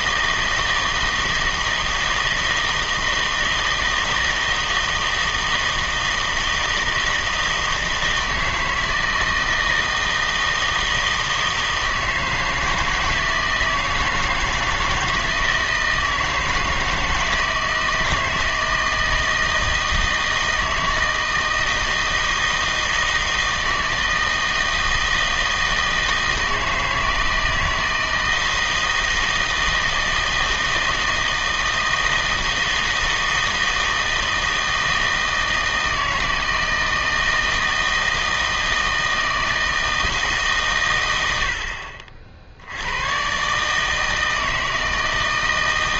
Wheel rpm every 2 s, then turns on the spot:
160, 160, 160, 160, 160, 160, 160, 160, 160, 160, 160, 160, 160, 160, 160, 160, 160, 160, 160, 160, 130, 80, 160.
none